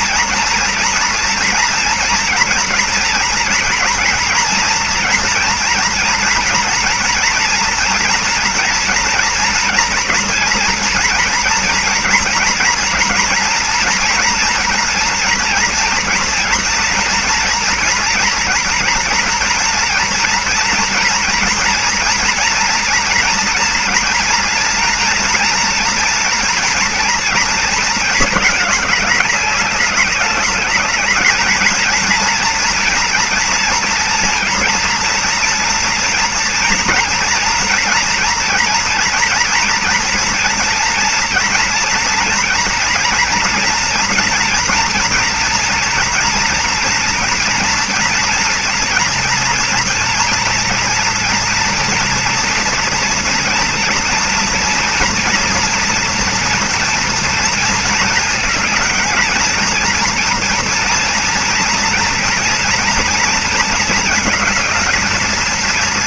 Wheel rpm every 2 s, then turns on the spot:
230, 230, 230, 230, 230, 230, 240, 230, 230, 230, 230, 230, 240, 230, 220, 210, 230, 230, 230, 230, 230, 230, 230, 230, 230, 230, 240, 230, 230, 220, 230, 230, 220.
none